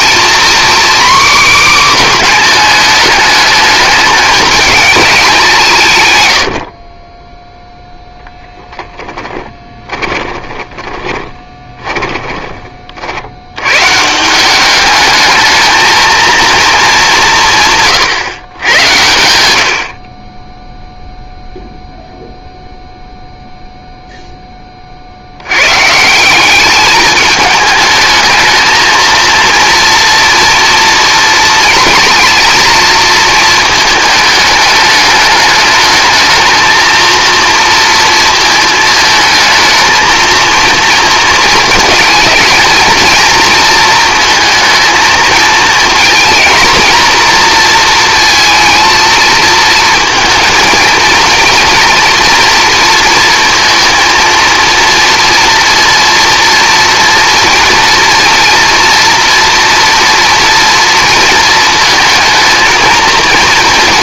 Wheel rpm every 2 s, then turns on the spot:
260, 230, 220, 50, 10, 20, 40, 210, 200, 110, 0, 0, 30, 210, 230, 230, 230, 210, 220, 220, 230, 230, 220, 240, 230, 230, 230, 230, 230, 230, 230, 230.
8-12